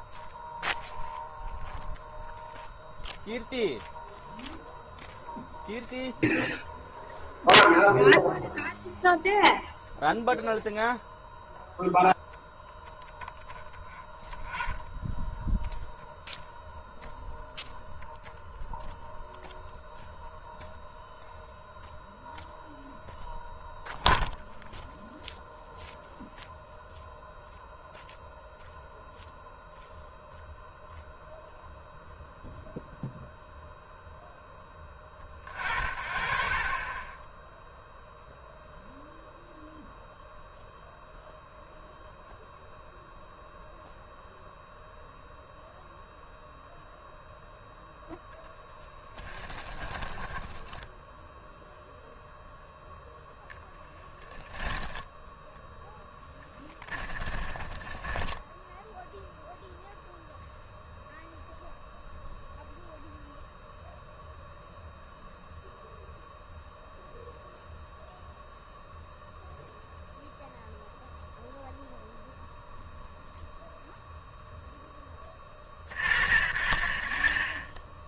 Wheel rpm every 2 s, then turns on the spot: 0, 0, 0, 0, 0, 0, 0, 0, 0, 0, 0, 0, 0, 0, 0, 0, 0, 10, 30, 0, 0, 0, 0, 0, 10, 10, 0, 10, 10, 0, 0, 0, 0, 0, 0, 0, 0, 0, 50.
50-52 54-58